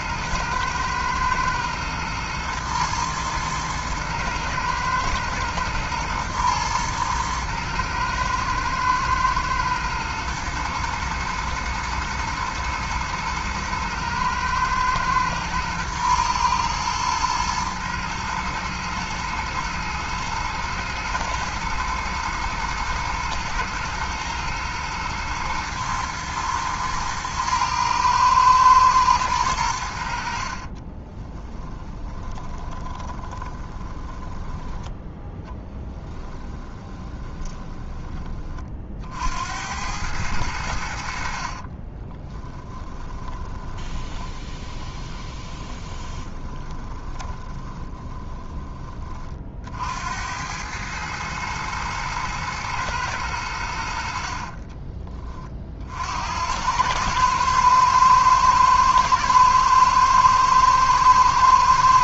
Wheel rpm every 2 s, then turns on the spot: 110, 110, 110, 110, 120, 110, 110, 110, 110, 110, 120, 110, 110, 110, 110, 20, 20, 10, 20, 50, 70, 10, 20, 20, 30, 110, 110, 20, 100, 110, 110.
30-34 36-38 42-48